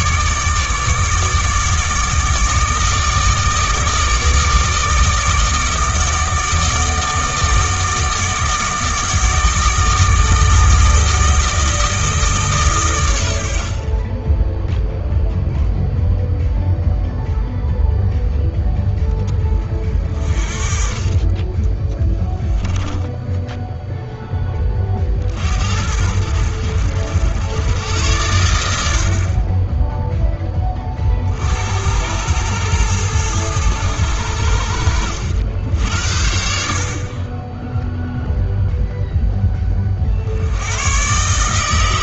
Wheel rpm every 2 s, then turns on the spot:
150, 160, 160, 160, 160, 160, 120, 0, 0, 10, 30, 10, 30, 80, 80, 30, 110, 70, 50, 0, 110.
22-24